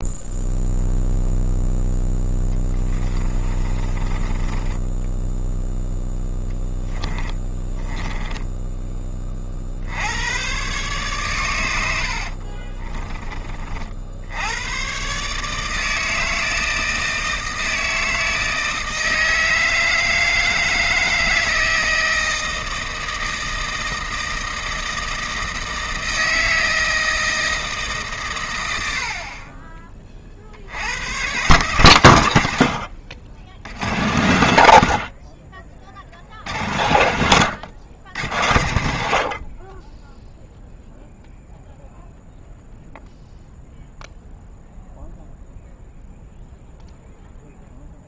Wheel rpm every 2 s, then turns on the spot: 0, 10, 10, 20, 10, 120, 30, 110, 160, 160, 160, 160, 160, 160, 90, 90, 70, 80, 80, 80, 0, 0, 0, 0.
2-8 12-14